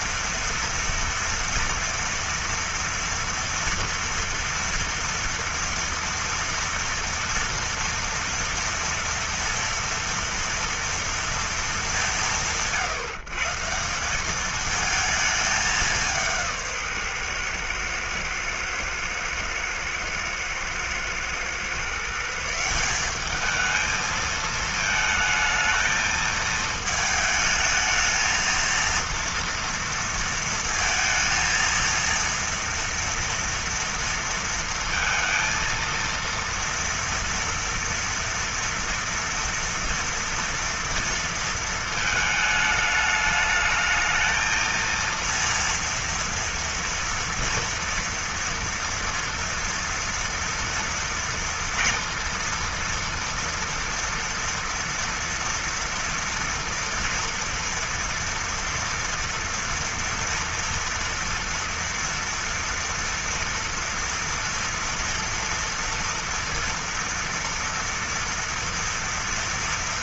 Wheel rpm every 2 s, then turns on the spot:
230, 230, 230, 230, 230, 230, 140, 210, 170, 110, 110, 160, 220, 220, 230, 230, 230, 230, 230, 230, 230, 210, 220, 230, 230, 240, 240, 230, 230, 230, 230, 240, 230, 230, 230.
none